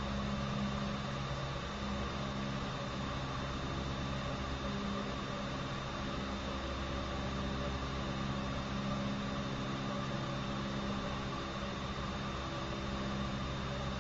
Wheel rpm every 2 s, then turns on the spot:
0, 0, 0, 0, 0, 0, 0.
none